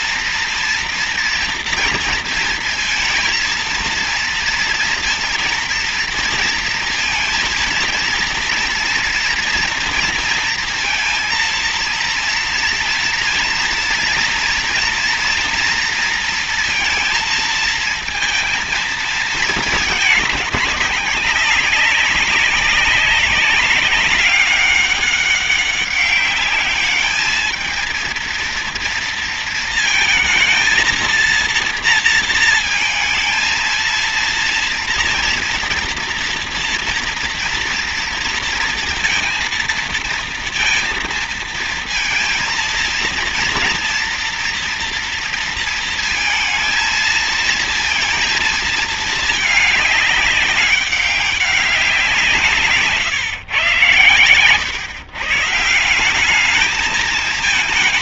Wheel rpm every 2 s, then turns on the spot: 230, 230, 230, 230, 230, 230, 240, 230, 230, 230, 200, 200, 200, 210, 230, 230, 230, 230, 230, 230, 230, 230, 230, 230, 220, 200, 130, 130, 220.
none